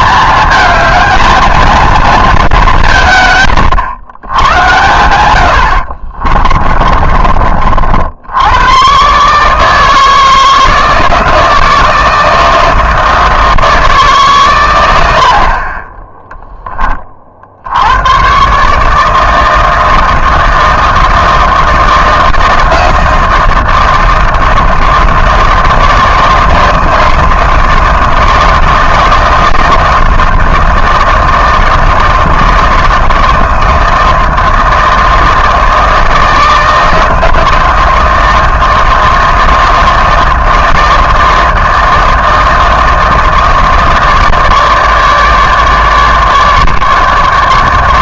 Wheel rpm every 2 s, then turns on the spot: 220, 200, 110, 30, 100, 160, 160, 110, 10, 140, 160, 160, 160, 160, 160, 160, 160, 160, 160, 160, 160, 160, 150, 150.
6-8